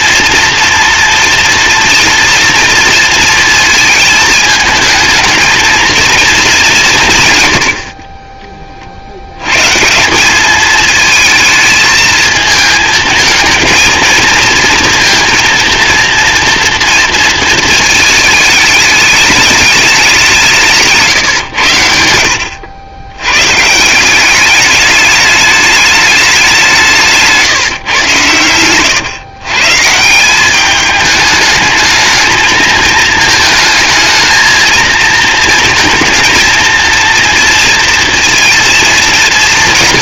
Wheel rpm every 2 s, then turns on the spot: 230, 230, 220, 190, 30, 210, 220, 230, 230, 210, 170, 90, 210, 180, 110, 200, 220, 220, 230, 220.
none